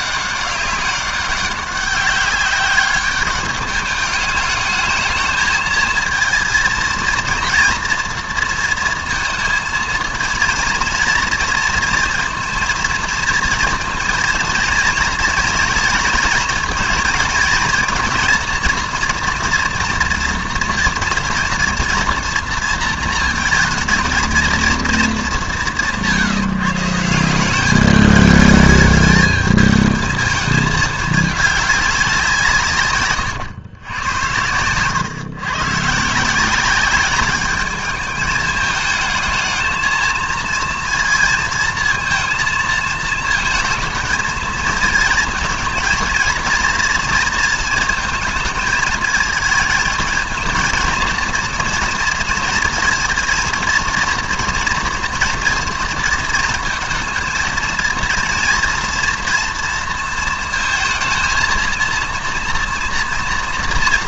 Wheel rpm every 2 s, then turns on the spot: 200, 200, 210, 220, 230, 230, 230, 230, 230, 230, 230, 230, 230, 160, 210, 220, 150, 100, 190, 210, 230, 230, 220, 230, 220, 230, 220, 230, 230, 230, 230, 230.
none